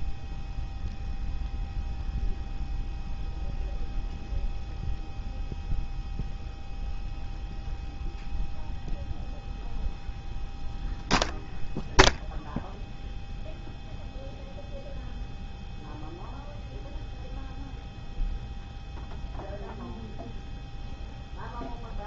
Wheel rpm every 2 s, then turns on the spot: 0, 0, 0, 0, 0, 0, 0, 0, 0, 0, 0.
none